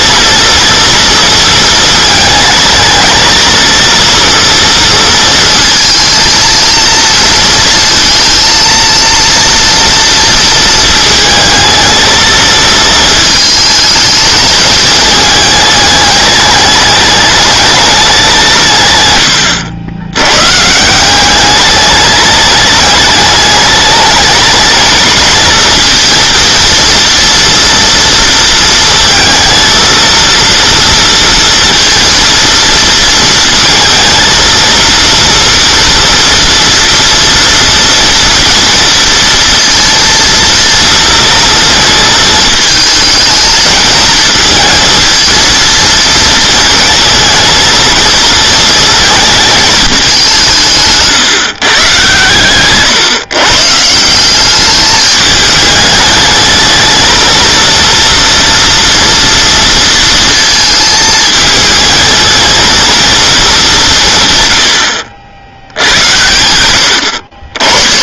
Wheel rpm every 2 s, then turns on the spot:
230, 220, 230, 230, 230, 230, 220, 220, 210, 150, 150, 210, 220, 230, 230, 230, 230, 230, 240, 230, 230, 220, 220, 220, 230, 150, 130, 200, 220, 230, 220, 230, 110, 80.
none